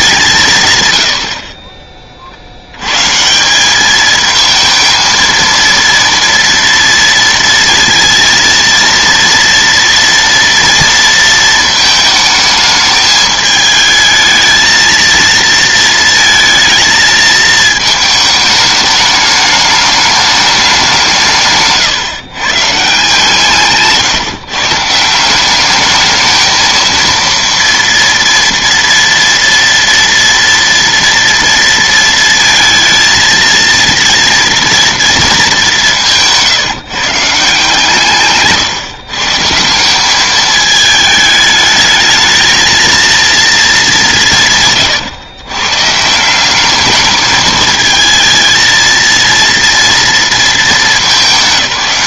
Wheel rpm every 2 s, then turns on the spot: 140, 100, 220, 230, 230, 230, 220, 220, 230, 210, 200, 150, 140, 220, 230, 230, 220, 230, 160, 140, 210, 220, 150, 200, 220, 220.
none